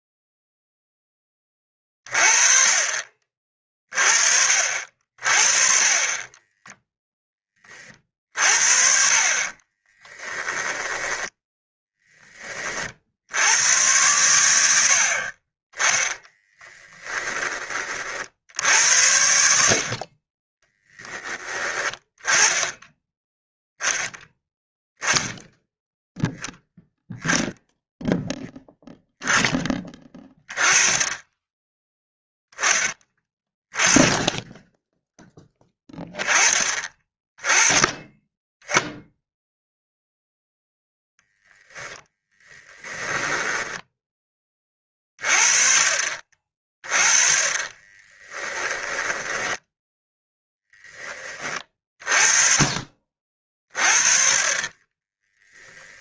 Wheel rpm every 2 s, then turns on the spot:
10, 40, 40, 10, 40, 10, 50, 80, 10, 70, 10, 10, 10, 0, 10, 10, 10, 10, 20, 0, 0, 10, 30, 30, 20, 20, 40, 20.
10-12 16-18 42-44 48-50 54-56